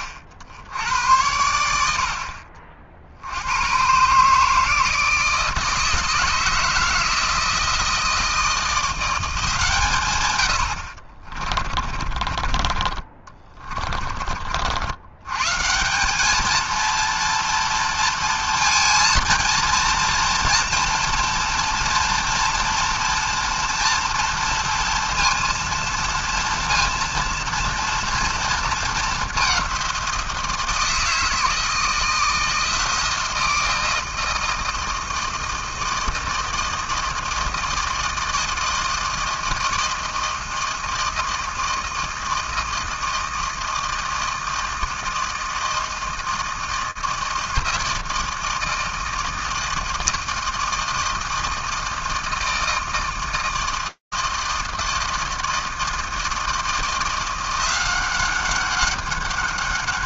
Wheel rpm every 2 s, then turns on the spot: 80, 50, 150, 160, 170, 100, 40, 60, 220, 230, 230, 240, 230, 230, 220, 160, 170, 160, 160, 160, 160, 160, 160, 160, 160, 160, 160, 160, 170, 200.
12-14